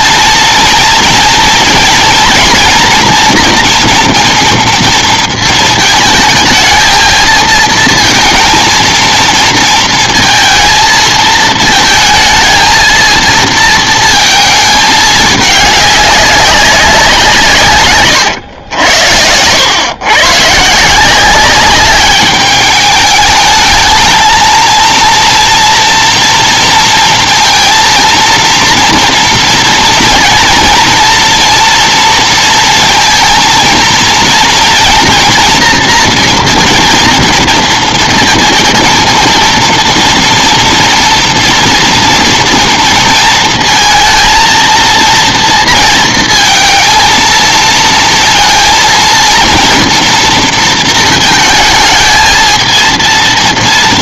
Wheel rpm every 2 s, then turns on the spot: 230, 230, 230, 220, 230, 220, 220, 220, 190, 100, 140, 210, 220, 230, 230, 230, 230, 240, 230, 230, 230, 230, 230, 230, 230, 230, 230.
none